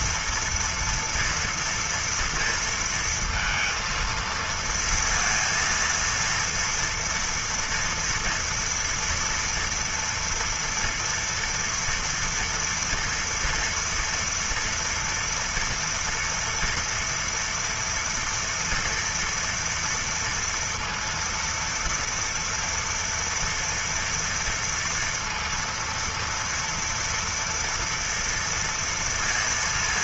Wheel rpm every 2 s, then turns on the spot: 230, 230, 230, 230, 230, 230, 240, 230, 230, 230, 230, 230, 230, 230, 230.
none